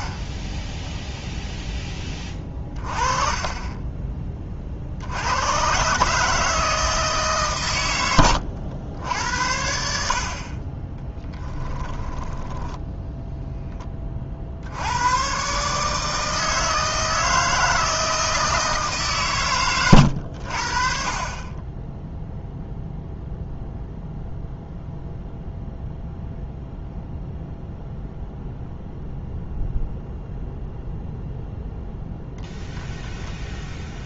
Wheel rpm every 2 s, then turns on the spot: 10, 30, 40, 160, 80, 30, 10, 70, 160, 160, 70, 0, 0, 0, 0, 0, 10.
2-4 12-14